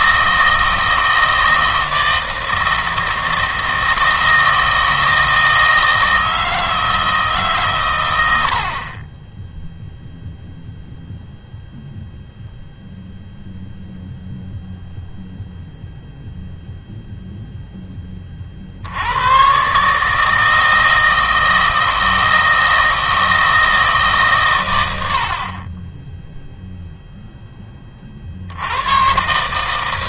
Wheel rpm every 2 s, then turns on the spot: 160, 160, 160, 160, 60, 0, 0, 0, 0, 70, 160, 160, 110, 0, 80.
none